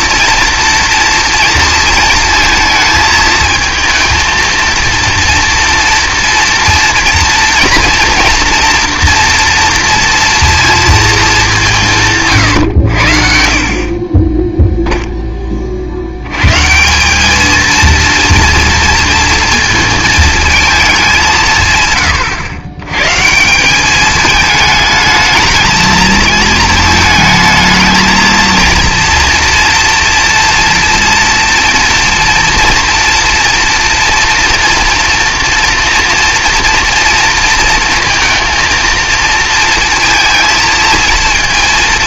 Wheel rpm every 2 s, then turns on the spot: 230, 220, 230, 230, 240, 210, 60, 10, 190, 230, 190, 130, 220, 220, 230, 230, 230, 230, 240, 220, 230.
none